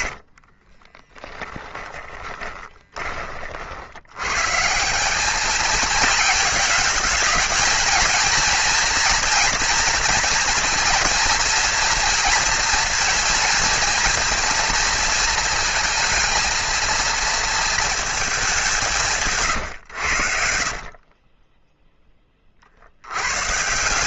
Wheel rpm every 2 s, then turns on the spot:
20, 20, 170, 220, 230, 230, 230, 230, 230, 180, 40, 80.
0-2 20-22